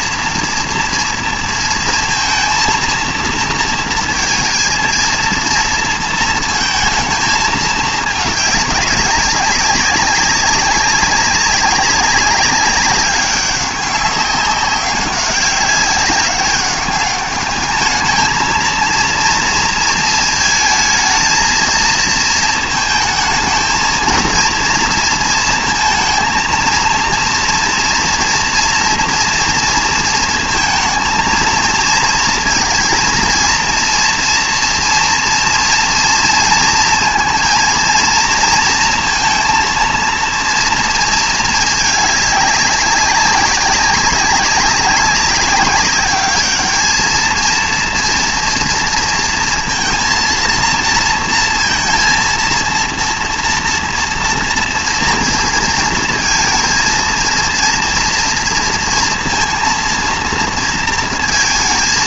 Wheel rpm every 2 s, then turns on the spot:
240, 230, 230, 230, 210, 190, 200, 190, 200, 220, 220, 220, 230, 230, 230, 230, 230, 230, 230, 230, 230, 200, 190, 210, 230, 230, 230, 230, 230, 230, 230.
none